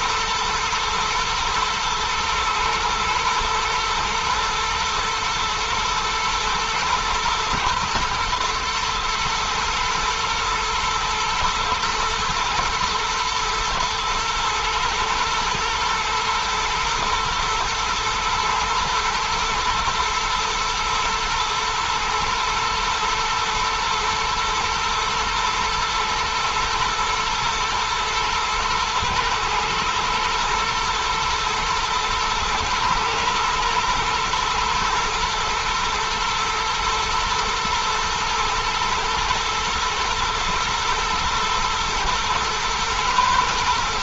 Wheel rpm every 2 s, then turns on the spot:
120, 120, 120, 110, 110, 110, 110, 120, 110, 120, 110, 120, 120, 120, 110, 110, 120, 110, 120, 120, 120, 110.
none